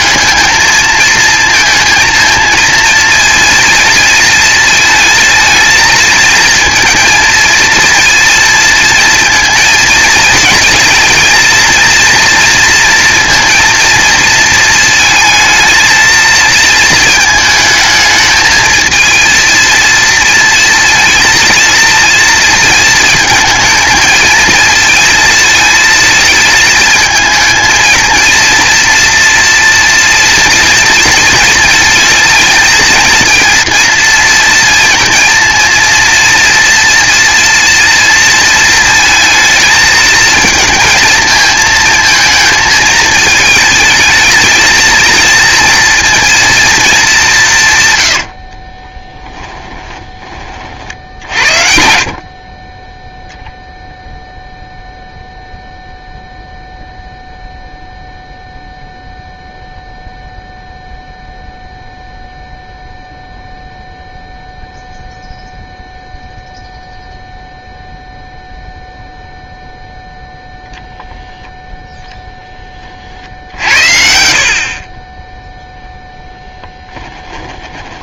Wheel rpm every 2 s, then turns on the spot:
230, 220, 220, 230, 230, 230, 230, 220, 220, 230, 230, 230, 220, 220, 230, 230, 230, 230, 230, 220, 220, 220, 230, 140, 10, 60, 0, 0, 0, 0, 0, 0, 0, 0, 0, 0, 30, 40, 10.
48-52 76-78